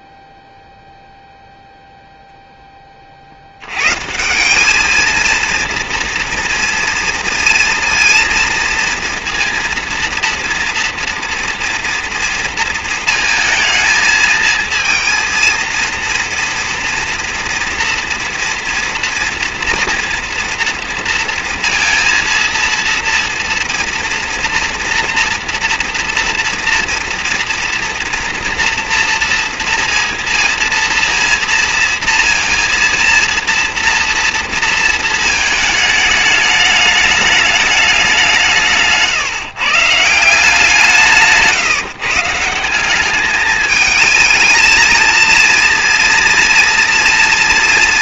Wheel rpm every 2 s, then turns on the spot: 0, 10, 200, 230, 230, 230, 230, 220, 240, 230, 230, 230, 240, 240, 240, 230, 230, 230, 210, 160, 170, 170, 220, 230.
none